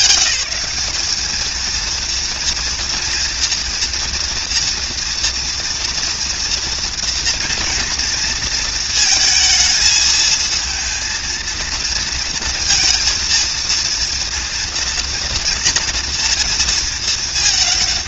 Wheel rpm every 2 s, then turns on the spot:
200, 230, 230, 230, 230, 230, 230, 230, 220.
none